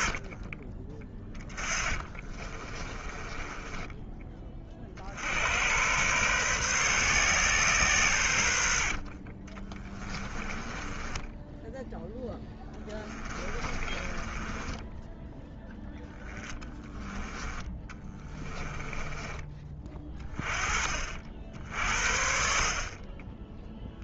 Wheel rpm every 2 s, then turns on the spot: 30, 30, 40, 130, 70, 20, 10, 20, 20, 20, 30, 50.
0-4 10-20